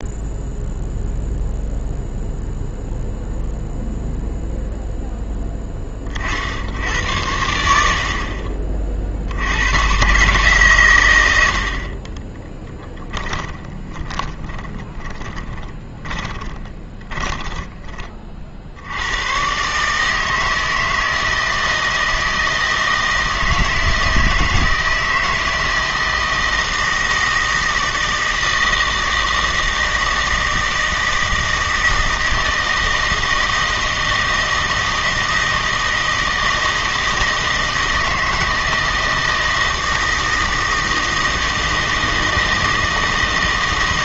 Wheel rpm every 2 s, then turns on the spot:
0, 0, 0, 80, 40, 130, 10, 10, 20, 60, 160, 160, 160, 160, 160, 160, 160, 160, 160, 160, 160, 160.
12-18